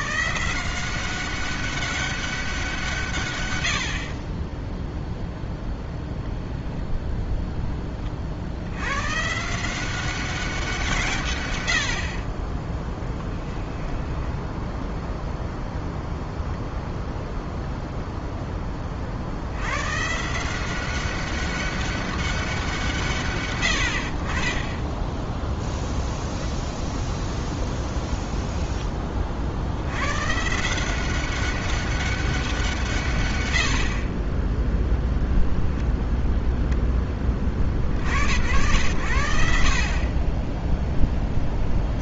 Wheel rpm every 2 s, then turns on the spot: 180, 180, 10, 10, 100, 170, 10, 10, 0, 30, 180, 180, 20, 0, 10, 160, 170, 0, 0, 80, 10.
none